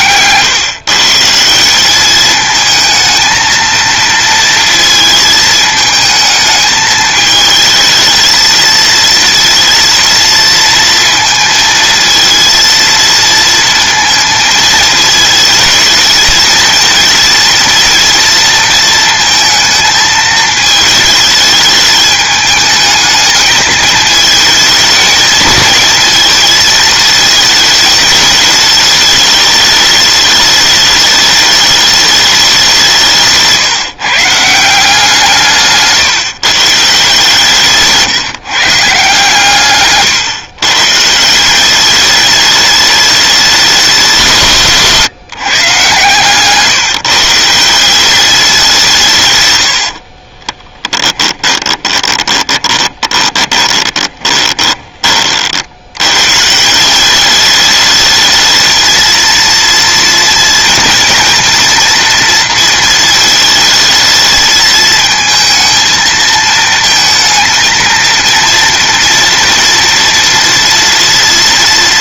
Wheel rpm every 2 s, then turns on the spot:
140, 220, 230, 220, 230, 230, 230, 220, 230, 230, 220, 220, 220, 220, 210, 210, 180, 170, 150, 140, 130, 210, 150, 150, 170, 20, 20, 30, 180, 220, 230, 230, 220, 230, 230, 230.
50-54